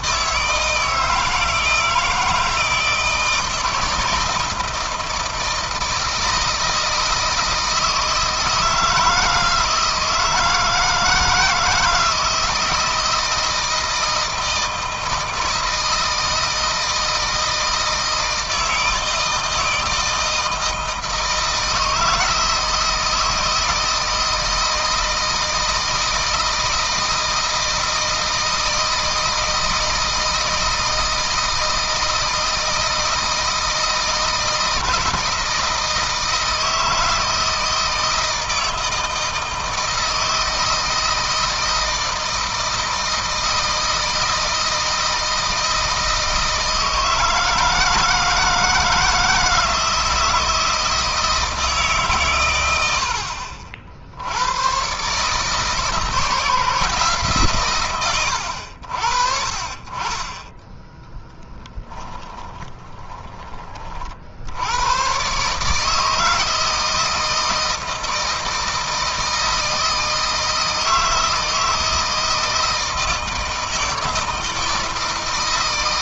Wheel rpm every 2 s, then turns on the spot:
160, 160, 160, 160, 160, 160, 160, 160, 160, 160, 160, 160, 160, 160, 160, 160, 160, 160, 160, 160, 160, 160, 160, 160, 160, 160, 60, 120, 160, 80, 20, 30, 120, 160, 160, 160, 160, 160.
60-64